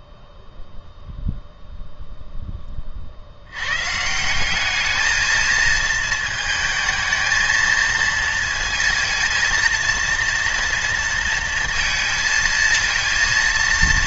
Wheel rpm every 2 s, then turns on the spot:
0, 20, 200, 220, 230, 230, 230.
none